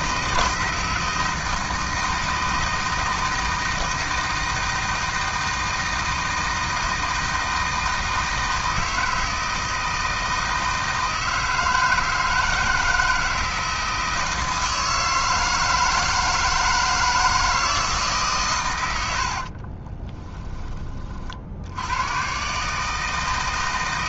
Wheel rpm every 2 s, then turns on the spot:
160, 160, 160, 160, 160, 160, 160, 160, 160, 130, 20, 140.
20-22